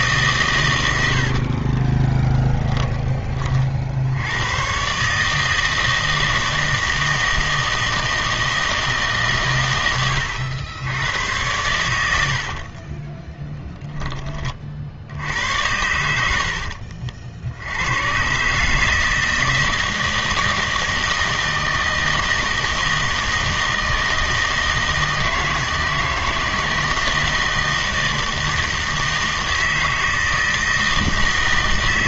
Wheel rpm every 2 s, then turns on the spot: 110, 20, 110, 160, 160, 90, 50, 40, 70, 150, 160, 160, 160, 160, 160, 160.
2-4 12-14 16-18